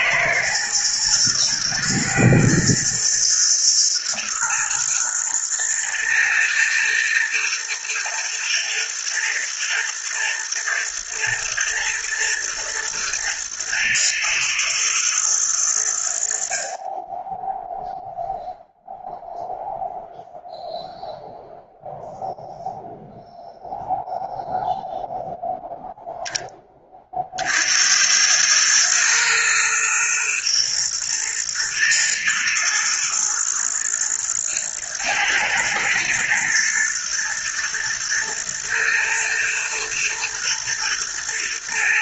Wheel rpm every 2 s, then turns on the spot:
110, 110, 110, 110, 120, 120, 110, 110, 40, 0, 0, 0, 0, 20, 110, 120, 110, 120, 120, 120, 120.
none